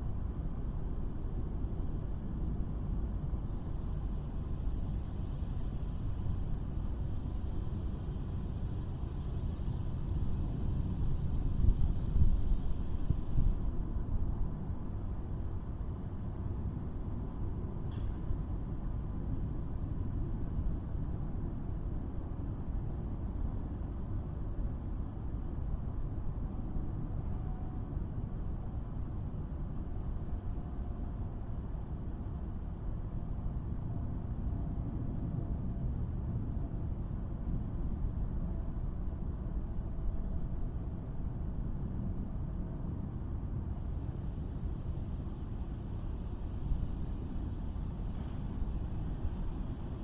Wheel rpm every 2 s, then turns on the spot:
0, 0, 0, 0, 0, 0, 0, 0, 0, 0, 0, 0, 0, 0, 0, 0, 0, 0, 0, 0, 0, 0, 0, 0, 0.
none